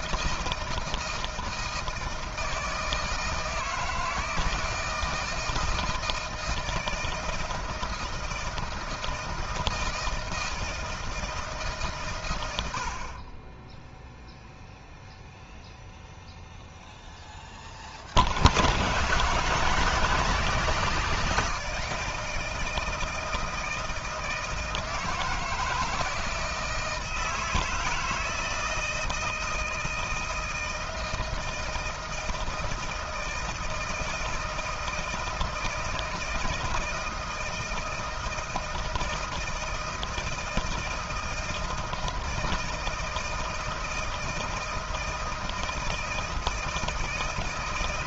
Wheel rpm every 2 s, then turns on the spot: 160, 160, 160, 160, 160, 160, 70, 0, 0, 130, 160, 160, 160, 160, 160, 160, 160, 160, 160, 160, 160, 160, 160, 160.
none